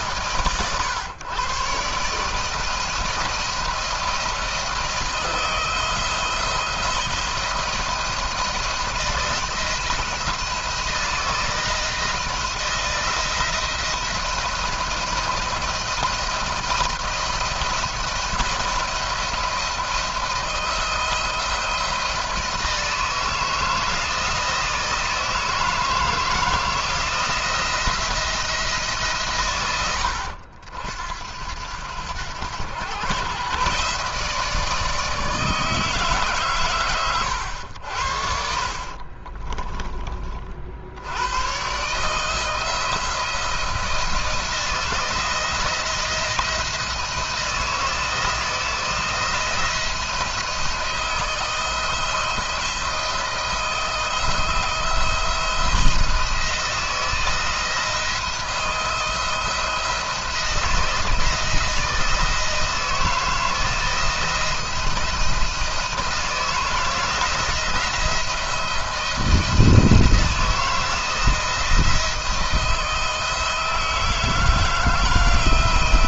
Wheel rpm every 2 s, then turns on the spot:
130, 160, 160, 170, 170, 160, 160, 170, 170, 170, 160, 160, 160, 160, 160, 70, 110, 160, 130, 50, 60, 170, 170, 170, 160, 170, 160, 160, 170, 170, 160, 160, 170, 160, 170, 170, 160, 160.
38-40